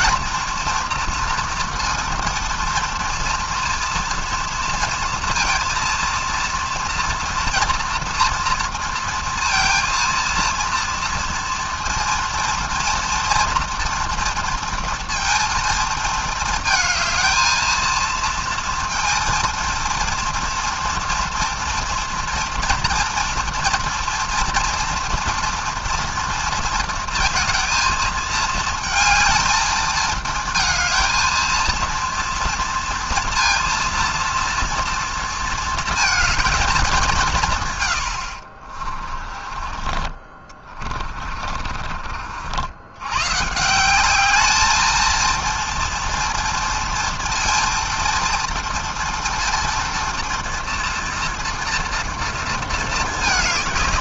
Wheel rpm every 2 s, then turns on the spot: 230, 230, 230, 230, 230, 230, 230, 230, 220, 230, 230, 230, 230, 230, 220, 230, 230, 240, 220, 40, 30, 80, 220, 230, 230, 230, 230.
38-42